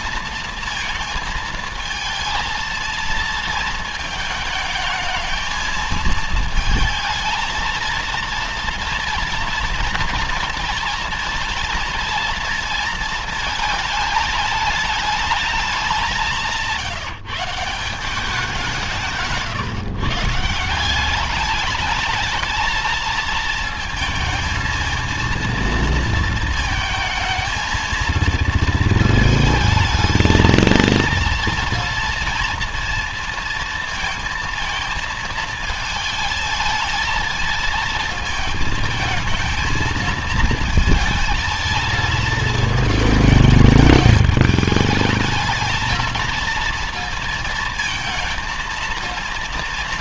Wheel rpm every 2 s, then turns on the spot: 220, 220, 220, 220, 230, 230, 230, 210, 170, 170, 170, 220, 220, 220, 220, 220, 230, 220, 220, 220, 220, 220, 210, 220, 230.
none